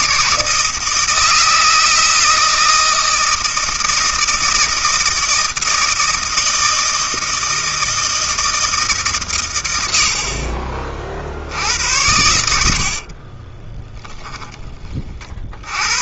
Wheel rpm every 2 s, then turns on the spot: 160, 160, 160, 160, 150, 40, 60, 30.
12-14